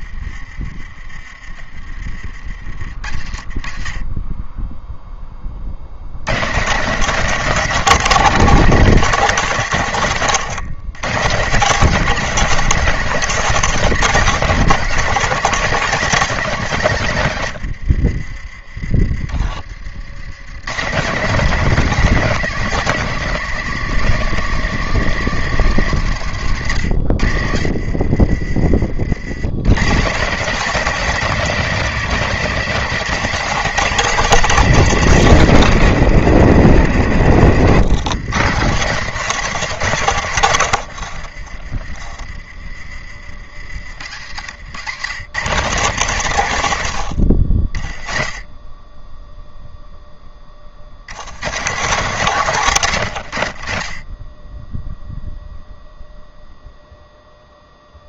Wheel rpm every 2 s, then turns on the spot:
30, 40, 10, 170, 200, 120, 210, 200, 160, 30, 150, 200, 190, 120, 50, 190, 200, 210, 160, 150, 100, 40, 100, 110, 10, 50, 140, 10, 0.
40-42